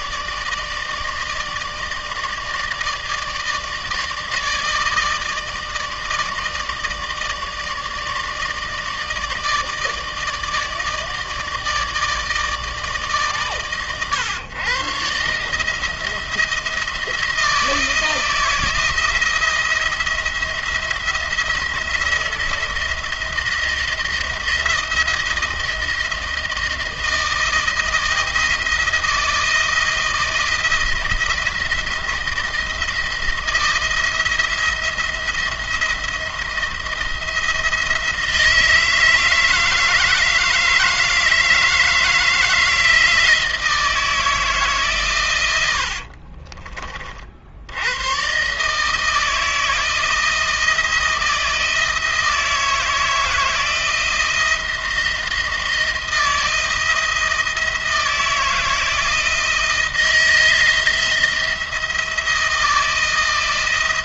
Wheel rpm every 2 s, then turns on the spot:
160, 160, 160, 160, 160, 160, 150, 130, 170, 170, 170, 170, 170, 160, 160, 160, 170, 170, 170, 160, 160, 160, 140, 40, 150, 160, 160, 170, 170, 160, 170, 160.
none